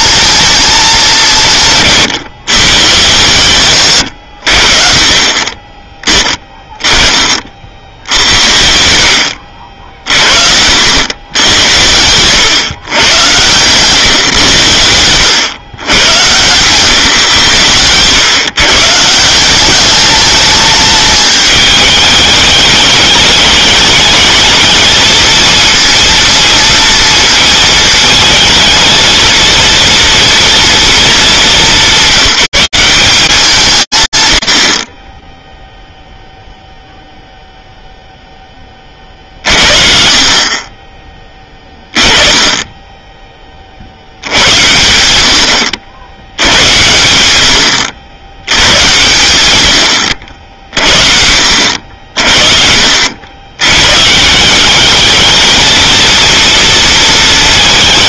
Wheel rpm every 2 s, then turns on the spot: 220, 130, 60, 20, 80, 70, 120, 90, 130, 140, 210, 210, 220, 230, 230, 240, 200, 50, 0, 50, 10, 20, 80, 100, 110, 50, 70, 210, 230.
8-10